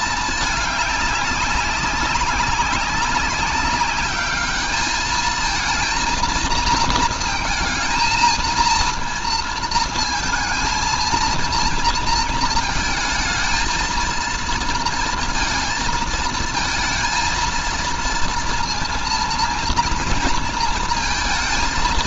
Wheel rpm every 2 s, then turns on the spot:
210, 190, 210, 230, 230, 230, 220, 230, 230, 230, 230.
none